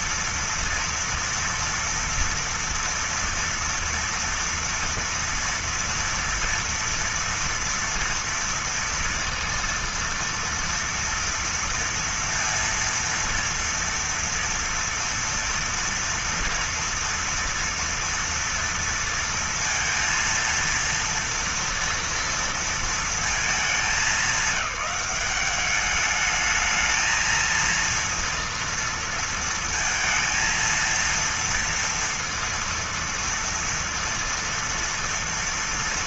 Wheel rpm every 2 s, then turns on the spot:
230, 230, 230, 230, 240, 230, 230, 230, 230, 230, 230, 230, 210, 220, 230, 230, 230, 230.
none